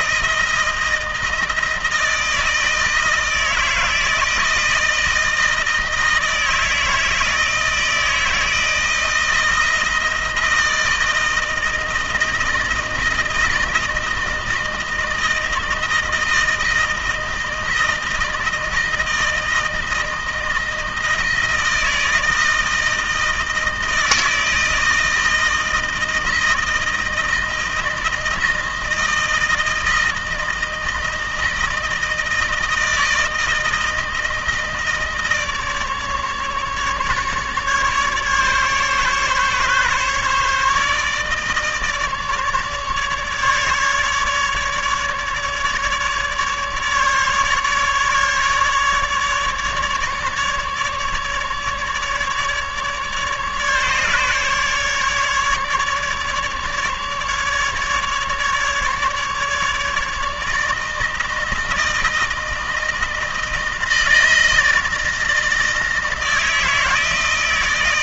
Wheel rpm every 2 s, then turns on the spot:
160, 160, 160, 160, 160, 160, 160, 160, 160, 160, 160, 160, 160, 160, 160, 160, 160, 160, 150, 140, 150, 150, 150, 150, 150, 150, 150, 150, 150, 150, 150, 160, 160, 160.
none